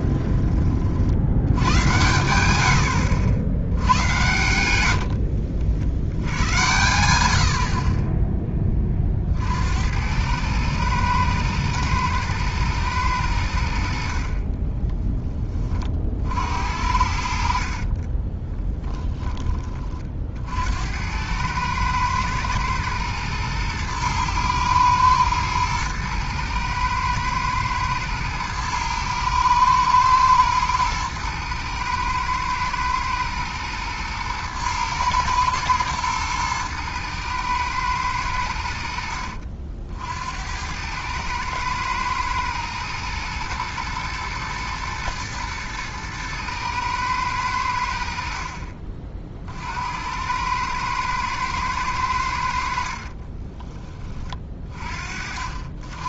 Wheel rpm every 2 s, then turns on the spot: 40, 80, 80, 100, 20, 110, 110, 10, 70, 10, 70, 110, 110, 110, 110, 110, 110, 110, 110, 80, 90, 110, 110, 110, 40, 110, 60, 40.
4-6 14-16 18-20